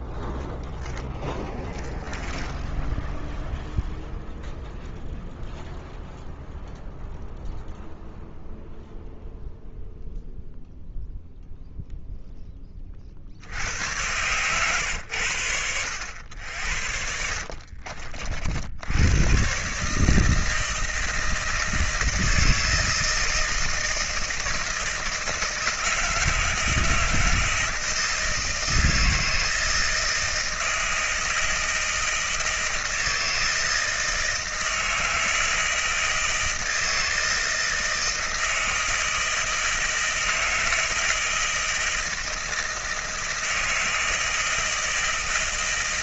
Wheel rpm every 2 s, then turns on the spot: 10, 10, 0, 0, 0, 0, 30, 110, 70, 90, 160, 160, 160, 160, 160, 160, 160, 160, 160, 160, 160, 160, 160.
0-2